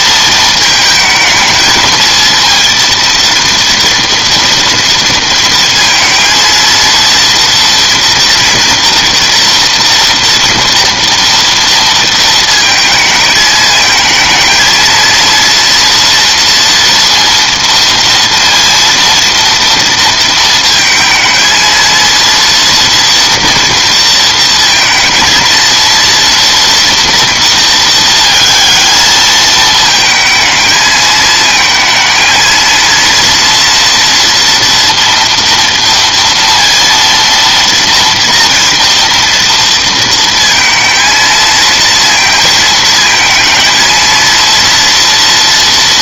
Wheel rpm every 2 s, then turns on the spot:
220, 230, 230, 240, 230, 230, 220, 230, 230, 230, 230, 230, 230, 230, 220, 220, 230, 230, 230, 230, 230, 230, 240.
none